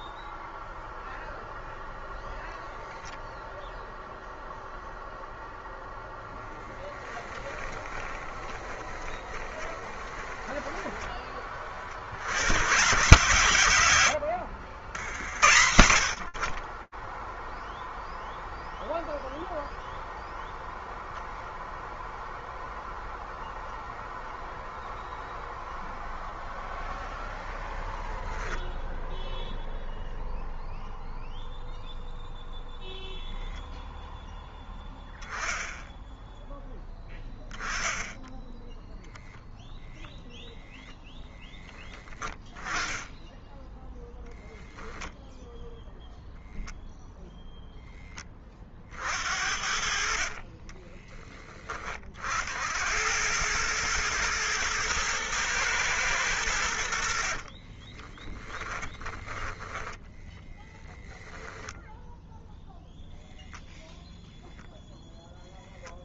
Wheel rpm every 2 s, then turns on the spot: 0, 0, 0, 10, 20, 10, 130, 60, 10, 0, 0, 0, 0, 0, 0, 0, 0, 10, 10, 0, 10, 10, 0, 0, 60, 10, 90, 120, 70, 10, 10, 0, 0.
6-12 56-62